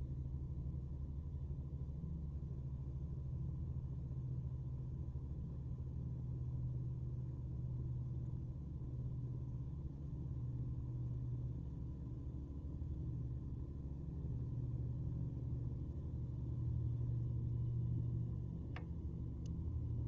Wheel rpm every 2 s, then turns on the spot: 0, 0, 0, 0, 0, 0, 0, 0, 0, 0.
none